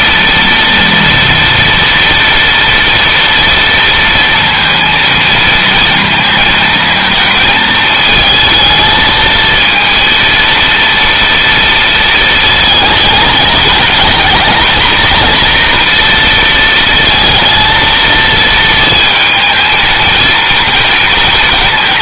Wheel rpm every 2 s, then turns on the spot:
230, 230, 230, 220, 220, 230, 210, 240, 230, 220, 230.
none